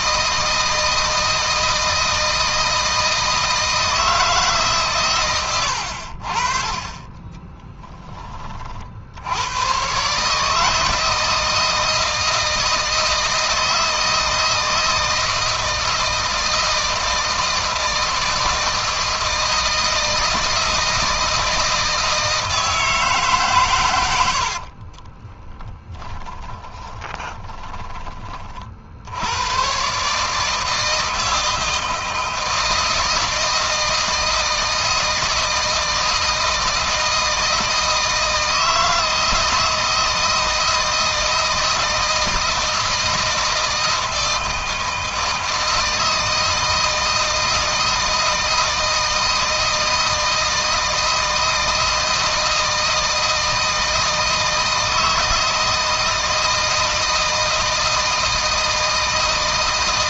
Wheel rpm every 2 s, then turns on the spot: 160, 160, 140, 30, 50, 160, 160, 160, 160, 160, 160, 150, 60, 20, 50, 160, 160, 160, 160, 160, 160, 160, 160, 160, 160, 160, 160, 160, 160, 160.
24-28